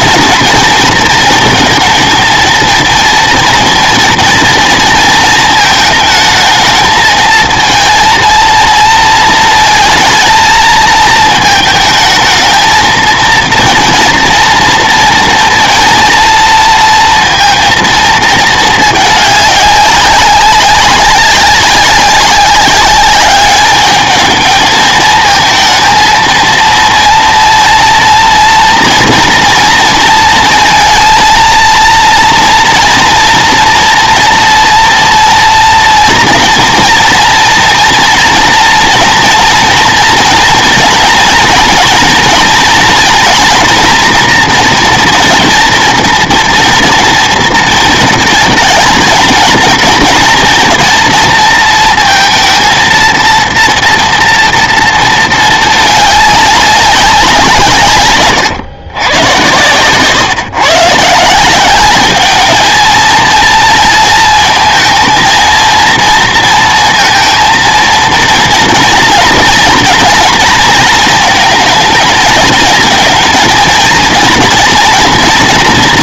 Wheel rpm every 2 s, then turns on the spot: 230, 230, 230, 220, 230, 220, 220, 230, 230, 220, 190, 200, 220, 230, 230, 230, 230, 230, 230, 230, 230, 230, 230, 230, 220, 230, 220, 230, 200, 120, 140, 220, 220, 230, 230, 230, 220, 240.
none